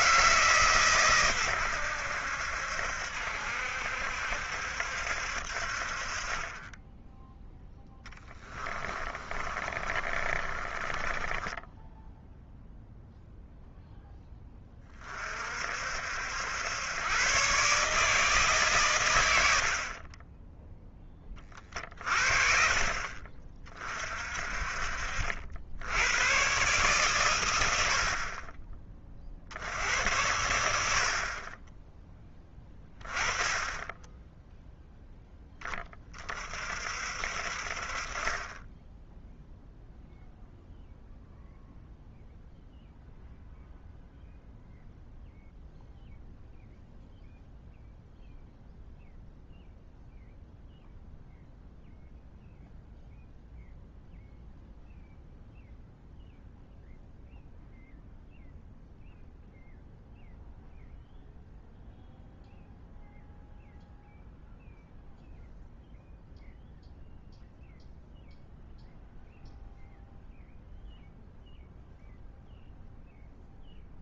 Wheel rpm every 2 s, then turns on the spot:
150, 70, 70, 20, 20, 30, 0, 20, 100, 140, 0, 40, 50, 130, 40, 80, 10, 0, 40, 10, 0, 0, 0, 0, 0, 0, 0, 0, 0, 0, 0, 0, 0, 0, 0, 0, 0.
8-12